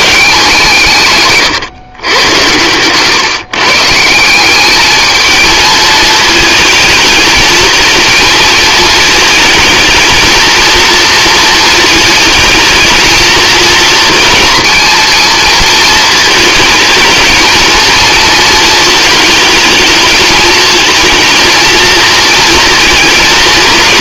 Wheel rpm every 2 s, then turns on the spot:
160, 110, 200, 220, 220, 220, 220, 230, 220, 230, 220, 230.
2-4